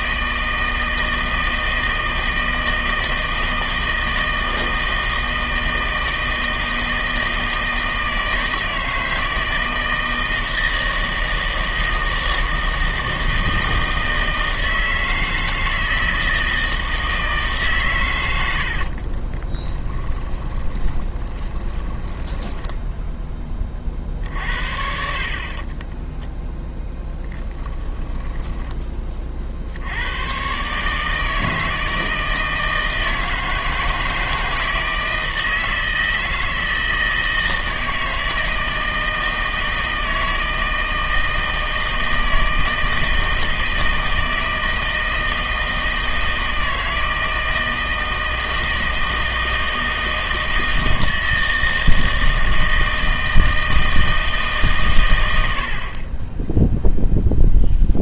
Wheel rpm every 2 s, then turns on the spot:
160, 160, 160, 160, 160, 160, 160, 160, 160, 60, 20, 10, 60, 10, 20, 140, 160, 160, 160, 160, 160, 160, 160, 160, 160, 160, 160, 130, 0.
18-24